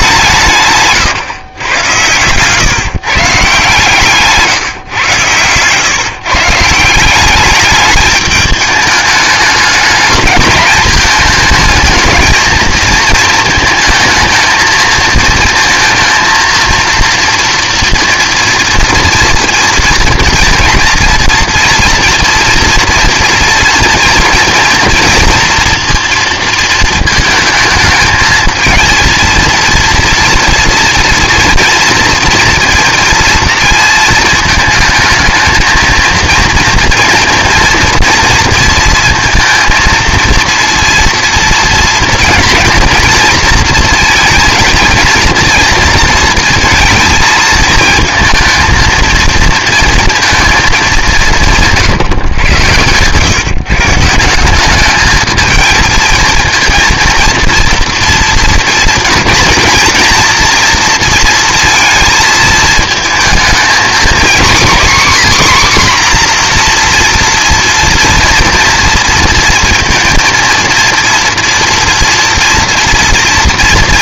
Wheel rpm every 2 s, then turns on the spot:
140, 130, 140, 150, 210, 210, 230, 220, 230, 230, 230, 230, 230, 230, 220, 230, 230, 220, 230, 230, 230, 230, 230, 220, 220, 220, 130, 190, 230, 230, 230, 220, 260, 240, 230, 230, 240.
none